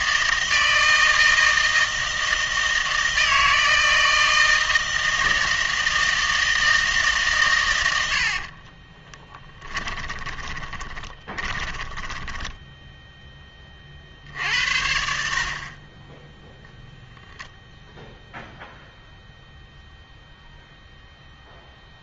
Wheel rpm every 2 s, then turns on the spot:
160, 160, 160, 160, 40, 20, 10, 70, 0, 0, 0.
8-14